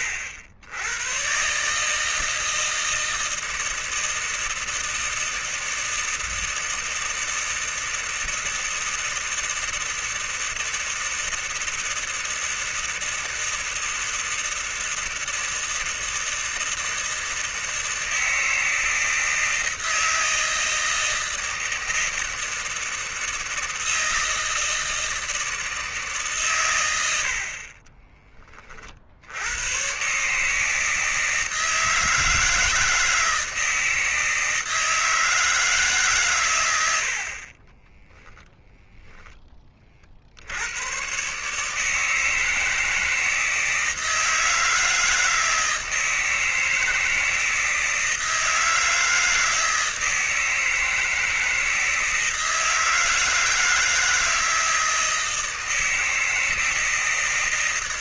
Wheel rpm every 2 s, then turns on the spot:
100, 160, 160, 160, 160, 160, 160, 160, 160, 160, 160, 160, 160, 110, 30, 150, 160, 160, 90, 0, 100, 160, 160, 160, 160, 160, 160, 160, 160.
none